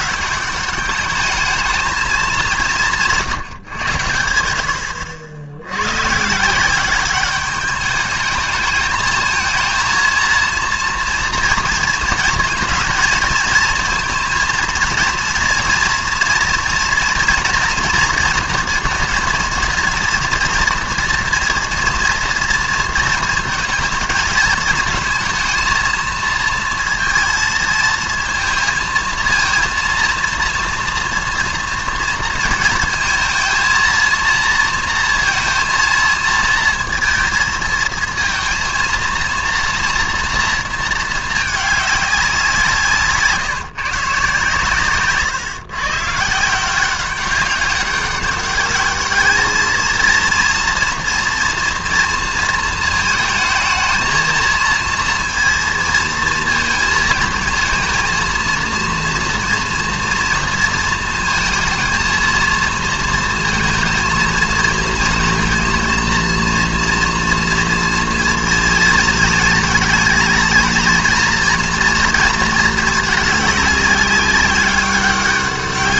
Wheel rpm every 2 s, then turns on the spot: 200, 190, 70, 160, 210, 230, 230, 230, 230, 230, 230, 230, 220, 220, 230, 230, 230, 230, 230, 230, 230, 180, 140, 160, 200, 230, 230, 220, 230, 230, 230, 230, 220, 230, 220, 220, 230, 200.
none